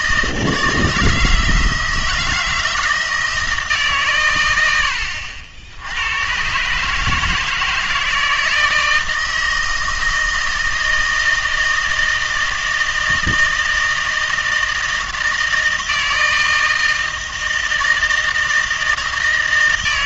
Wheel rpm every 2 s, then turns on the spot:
160, 160, 100, 140, 160, 160, 160, 160, 160, 160.
none